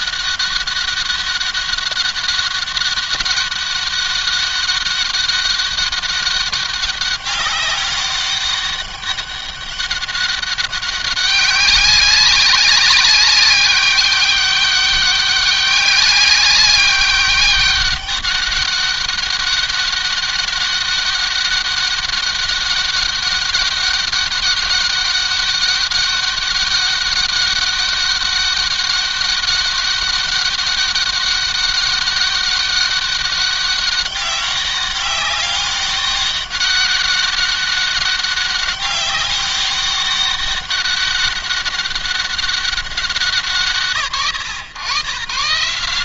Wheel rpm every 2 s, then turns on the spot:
200, 200, 200, 200, 200, 200, 200, 200, 200, 200, 200, 200, 200, 200, 200, 200, 200, 190, 200, 200, 200, 190, 120.
none